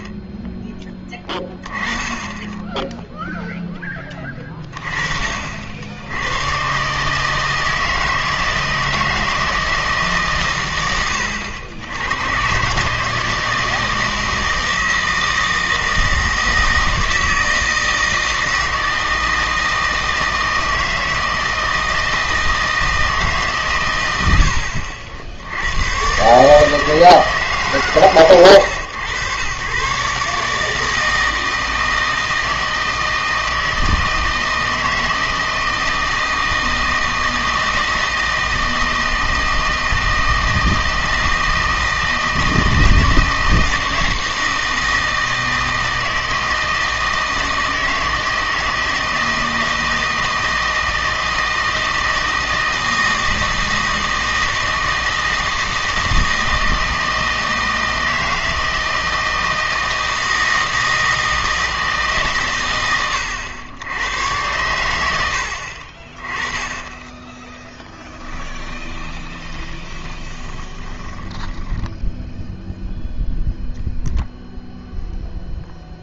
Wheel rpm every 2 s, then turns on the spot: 10, 10, 20, 130, 160, 100, 140, 160, 160, 160, 160, 160, 70, 160, 110, 160, 160, 160, 160, 160, 160, 160, 160, 160, 160, 160, 160, 160, 160, 160, 160, 100, 100, 10, 20, 10, 0, 0.
68-72